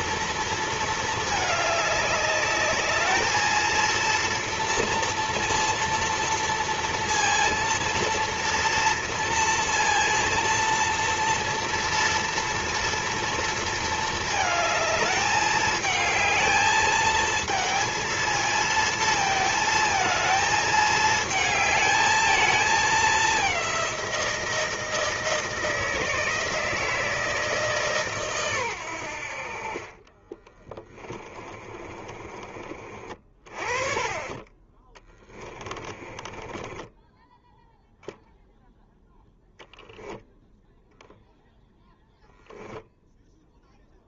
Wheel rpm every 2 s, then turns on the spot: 230, 200, 230, 230, 230, 230, 230, 220, 220, 220, 220, 220, 170, 160, 130, 20, 30, 20, 20, 0, 0, 0.
30-32 36-38